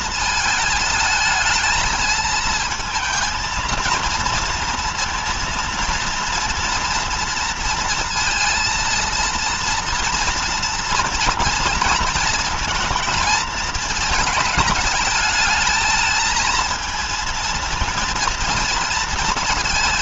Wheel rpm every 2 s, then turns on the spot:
220, 220, 230, 230, 230, 230, 230, 220, 220, 220.
none